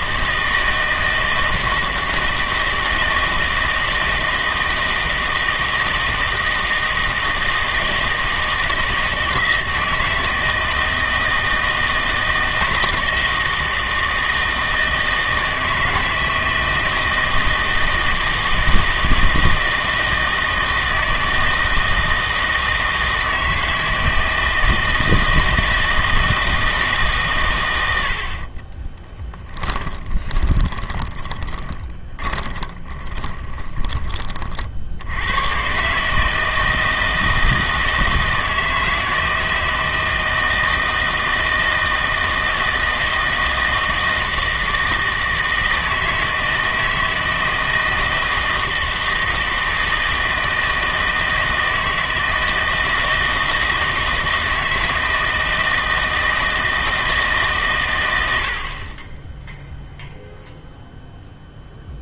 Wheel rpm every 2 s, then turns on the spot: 160, 160, 160, 160, 160, 160, 160, 160, 160, 160, 160, 160, 160, 160, 30, 20, 20, 50, 160, 160, 160, 160, 160, 160, 160, 160, 160, 160, 160, 50, 0.
28-34